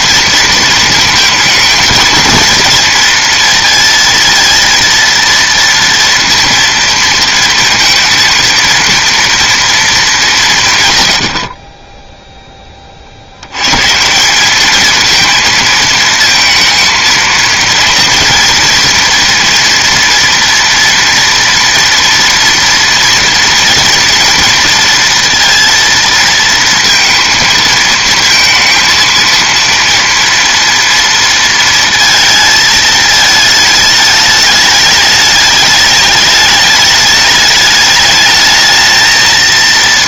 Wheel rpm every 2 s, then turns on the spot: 230, 230, 230, 230, 230, 150, 20, 210, 220, 240, 240, 230, 230, 230, 230, 230, 220, 210, 210, 220.
none